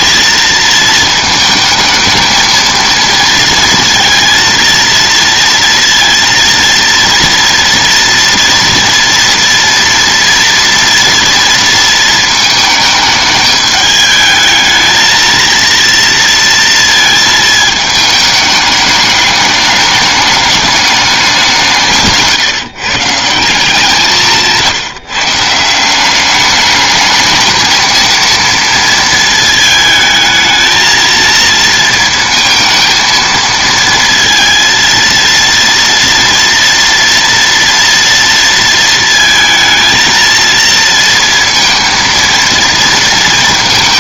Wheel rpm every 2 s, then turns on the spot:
230, 220, 230, 230, 230, 230, 230, 210, 230, 220, 210, 160, 170, 190, 230, 220, 230, 230, 230, 230, 230, 230.
none